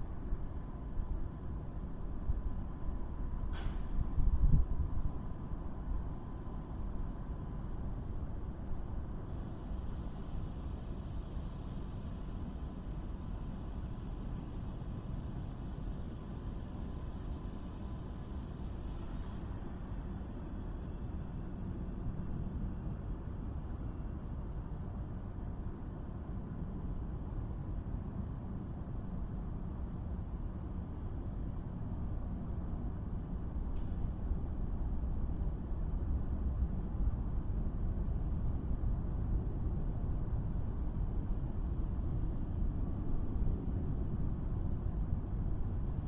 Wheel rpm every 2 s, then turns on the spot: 0, 0, 0, 0, 0, 0, 0, 0, 0, 0, 0, 0, 0, 0, 0, 0, 0, 0, 0, 0, 0, 0, 0.
none